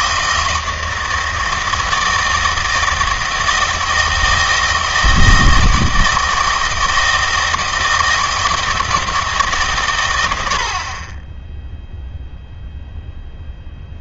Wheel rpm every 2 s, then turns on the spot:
160, 160, 160, 160, 160, 70, 0.
none